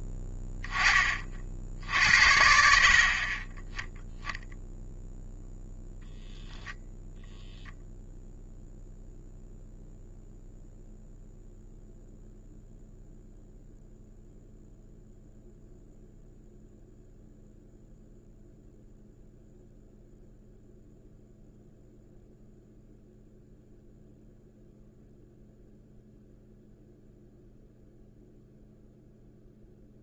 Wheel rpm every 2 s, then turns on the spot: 20, 60, 0, 10, 0, 0, 0, 0, 0, 0, 0, 0, 0, 0, 0.
none